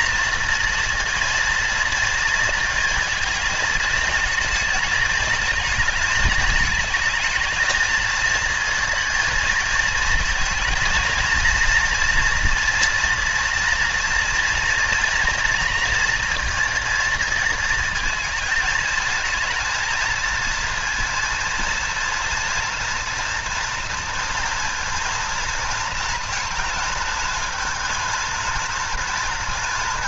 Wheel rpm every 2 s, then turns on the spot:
230, 230, 220, 220, 230, 230, 230, 230, 230, 220, 230, 230, 230, 220, 230.
none